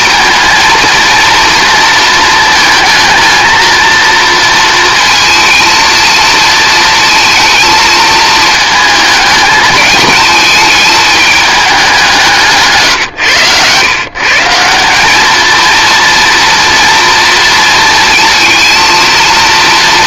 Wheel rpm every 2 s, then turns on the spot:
230, 220, 230, 220, 220, 220, 140, 190, 230, 230.
none